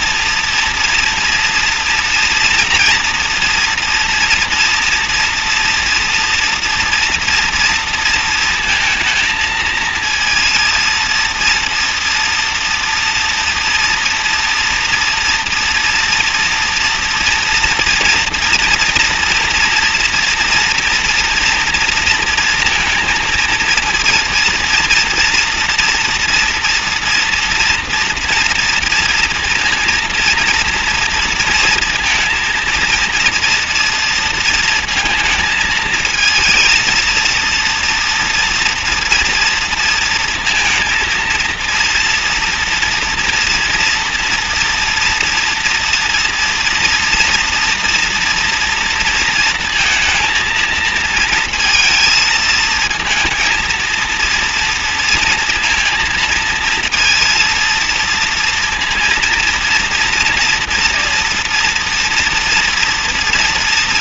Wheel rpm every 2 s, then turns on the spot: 230, 230, 230, 230, 220, 230, 230, 240, 230, 230, 230, 230, 230, 230, 230, 230, 230, 220, 230, 230, 230, 230, 240, 240, 230, 220, 230, 230, 230, 230, 230, 230.
none